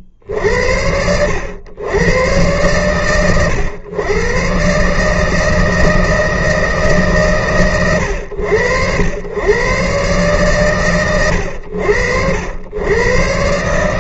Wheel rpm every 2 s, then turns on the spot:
60, 100, 110, 160, 110, 140, 70.
none